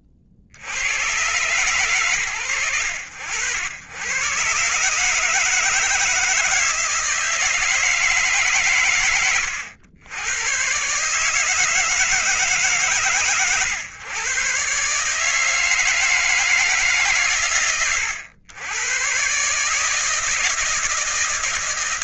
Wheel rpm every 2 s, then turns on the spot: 40, 80, 120, 160, 130, 130, 140, 140, 160, 110, 160.
none